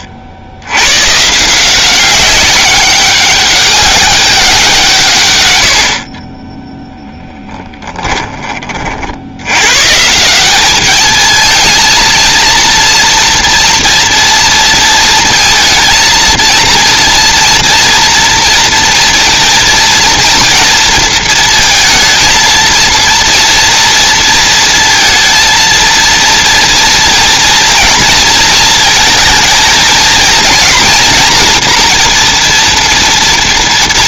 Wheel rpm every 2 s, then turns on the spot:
60, 190, 180, 10, 30, 200, 230, 230, 230, 230, 230, 230, 230, 230, 230, 230, 230.
none